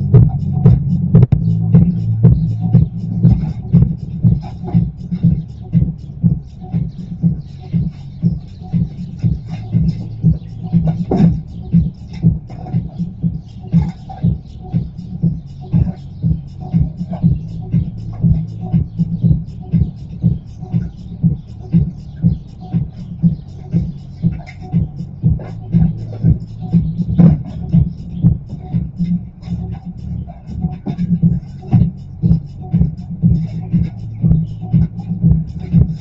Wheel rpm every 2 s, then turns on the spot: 0, 0, 0, 0, 0, 0, 0, 0, 0, 0, 0, 0, 0, 0, 0, 0, 0, 0.
none